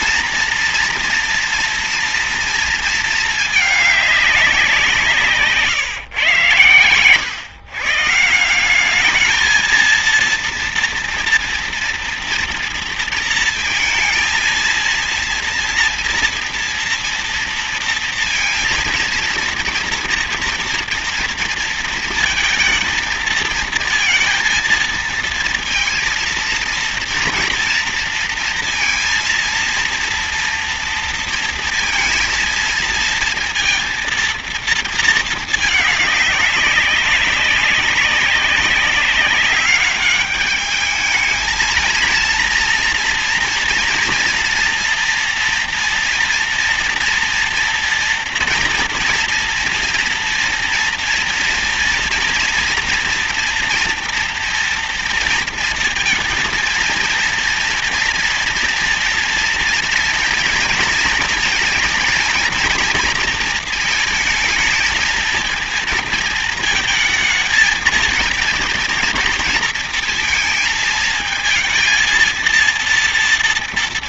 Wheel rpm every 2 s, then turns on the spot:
240, 220, 180, 130, 180, 230, 230, 230, 230, 230, 230, 220, 230, 230, 230, 230, 230, 230, 200, 200, 210, 230, 230, 230, 230, 240, 230, 230, 230, 230, 230, 230, 220, 220, 230, 230, 230.
none